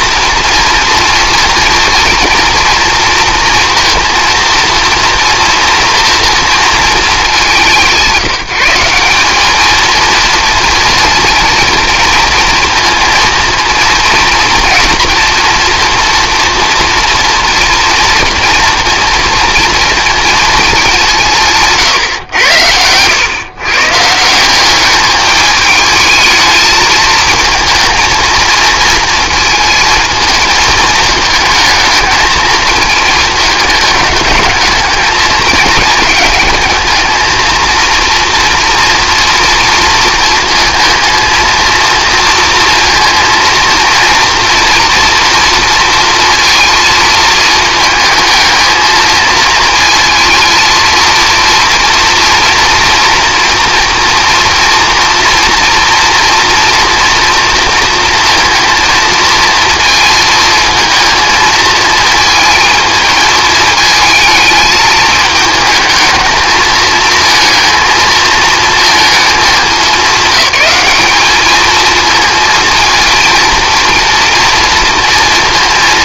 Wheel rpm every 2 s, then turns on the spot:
230, 230, 230, 230, 180, 240, 230, 230, 230, 230, 210, 110, 200, 220, 220, 220, 220, 220, 220, 230, 230, 230, 230, 230, 220, 230, 230, 230, 230, 230, 230, 220, 220, 220, 230, 200, 230, 230.
none